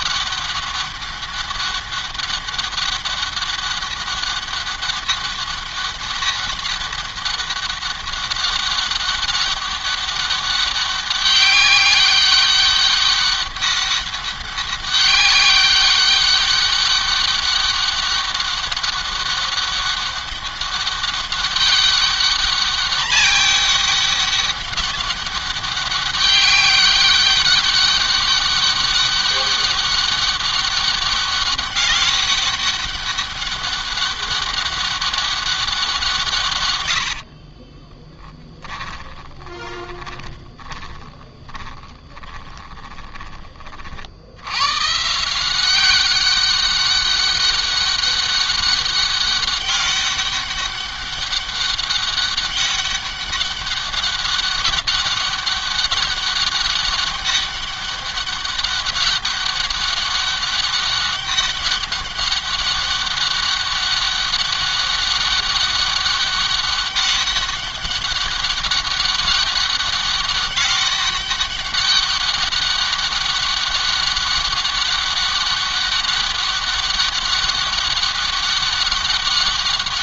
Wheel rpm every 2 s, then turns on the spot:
200, 200, 200, 200, 200, 200, 190, 200, 200, 200, 200, 200, 200, 190, 200, 200, 200, 200, 140, 20, 20, 20, 100, 200, 200, 200, 200, 190, 200, 200, 200, 200, 200, 200, 200, 200, 200, 200, 200, 200.
38-44